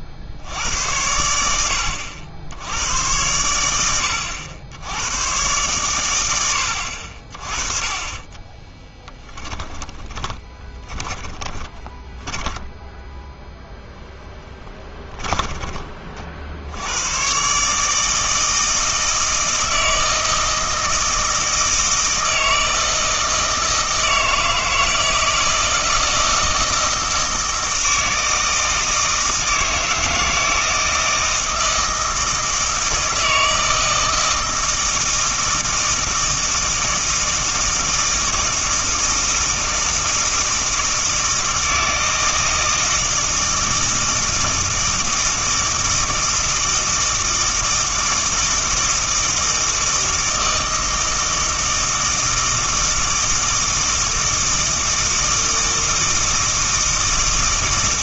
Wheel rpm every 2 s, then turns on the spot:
80, 90, 80, 80, 20, 40, 10, 10, 70, 160, 160, 160, 160, 160, 160, 160, 160, 160, 160, 160, 160, 160, 160, 160, 160, 160, 160, 160, 160.
8-16